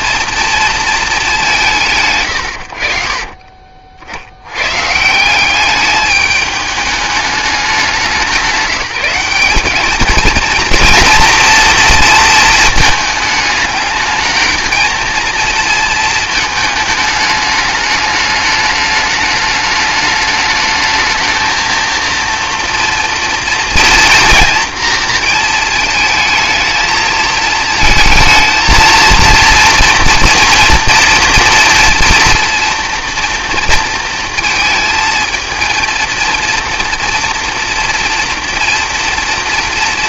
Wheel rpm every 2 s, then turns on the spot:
230, 60, 140, 210, 180, 230, 220, 220, 210, 210, 220, 230, 230, 220, 230, 230, 230, 220, 230, 230.
none